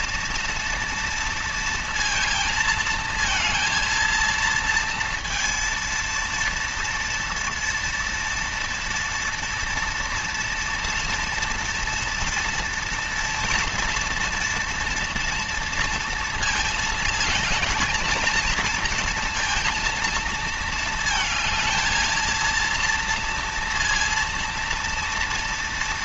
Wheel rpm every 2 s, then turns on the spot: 230, 230, 230, 230, 230, 230, 230, 230, 220, 230, 220, 230, 230.
none